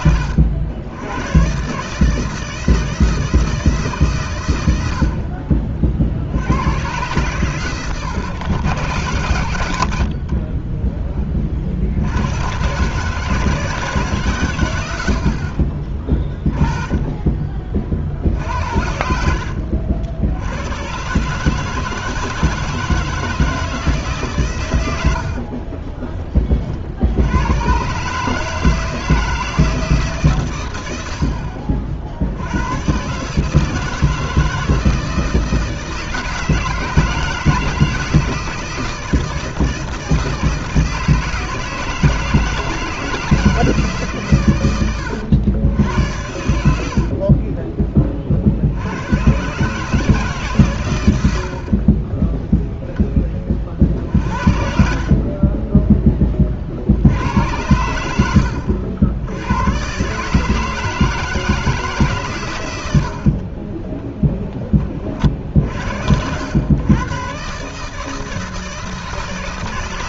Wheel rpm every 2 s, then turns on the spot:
80, 160, 70, 110, 120, 20, 130, 90, 20, 60, 120, 160, 110, 70, 160, 90, 120, 160, 160, 160, 160, 160, 100, 70, 90, 110, 0, 50, 60, 80, 160, 100, 30, 110, 160.
18-20 54-56 62-64